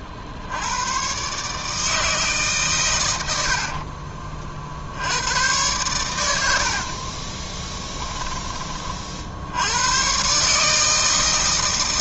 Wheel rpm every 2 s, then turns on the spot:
70, 150, 50, 80, 20, 140.
6-8